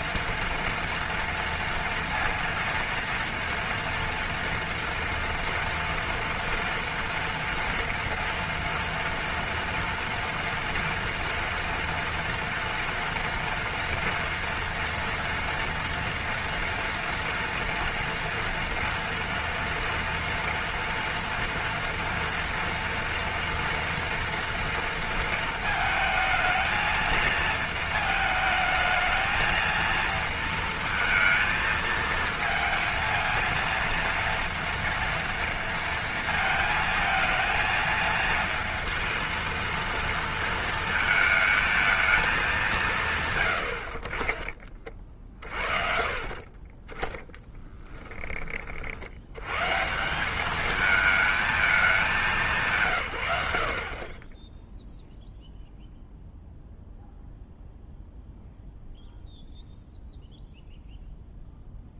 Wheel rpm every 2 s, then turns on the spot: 230, 230, 230, 230, 230, 230, 230, 230, 230, 230, 240, 230, 230, 220, 220, 230, 220, 230, 230, 230, 230, 200, 30, 40, 30, 210, 180, 10, 0, 0, 0.
44-48